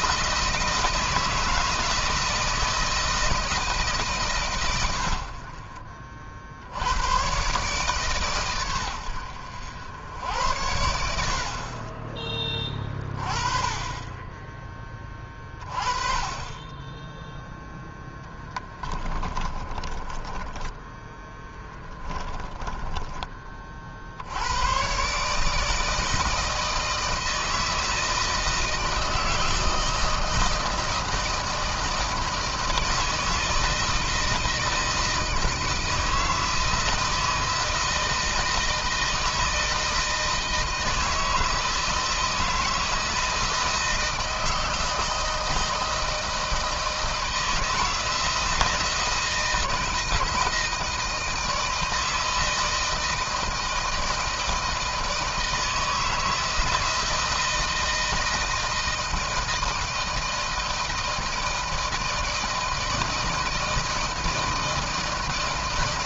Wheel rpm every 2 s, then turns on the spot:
160, 160, 150, 60, 130, 90, 30, 20, 20, 20, 20, 20, 70, 160, 160, 160, 160, 160, 160, 160, 160, 160, 160, 160, 160, 160, 160, 160, 160, 160, 160, 170, 160.
18-24